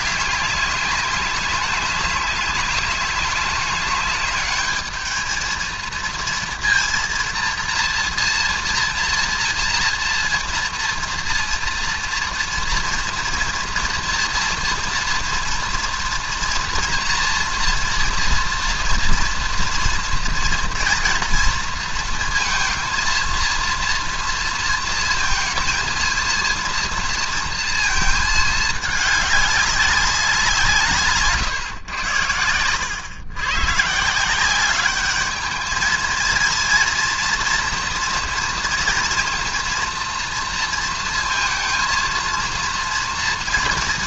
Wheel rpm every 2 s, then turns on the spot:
200, 200, 210, 230, 230, 230, 230, 230, 230, 230, 230, 230, 230, 230, 220, 190, 100, 160, 220, 230, 230, 230.
none